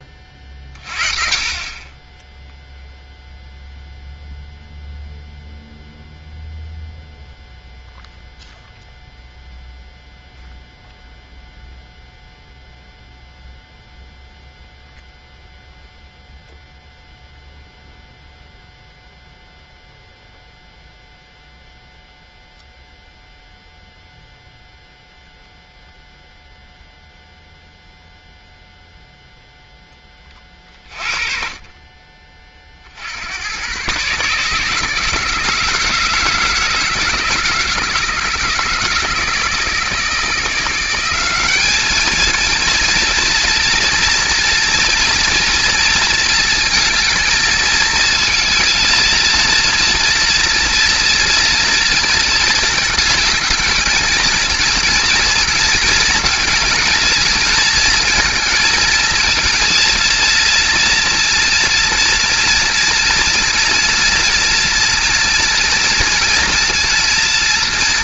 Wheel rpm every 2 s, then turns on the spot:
40, 0, 0, 0, 0, 0, 0, 0, 0, 0, 0, 0, 0, 0, 0, 30, 20, 150, 160, 160, 170, 240, 230, 220, 230, 230, 230, 230, 230, 220, 230, 240, 230, 230.
none